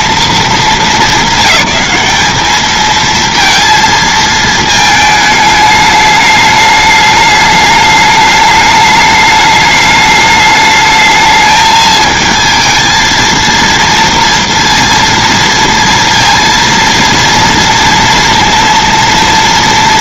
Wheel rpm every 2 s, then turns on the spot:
230, 210, 230, 210, 210, 210, 220, 230, 230, 230.
none